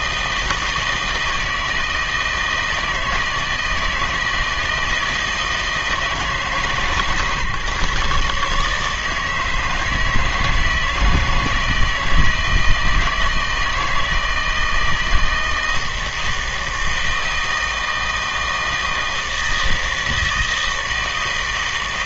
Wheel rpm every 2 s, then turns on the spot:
160, 160, 160, 150, 150, 160, 160, 160, 160, 160, 160.
none